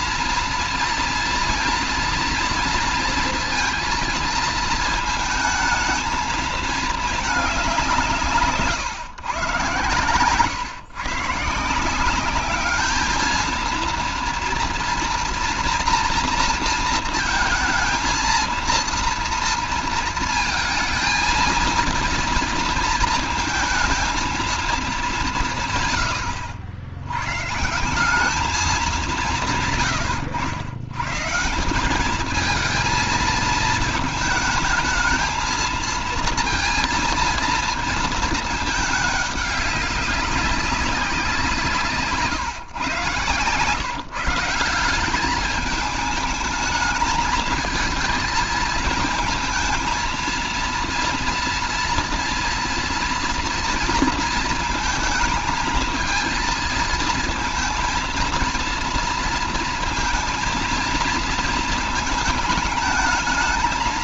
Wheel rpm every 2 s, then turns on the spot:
240, 230, 230, 220, 160, 160, 200, 230, 230, 230, 230, 230, 220, 90, 210, 100, 220, 220, 230, 220, 200, 130, 160, 210, 220, 230, 230, 220, 220, 230, 220, 220.
8-10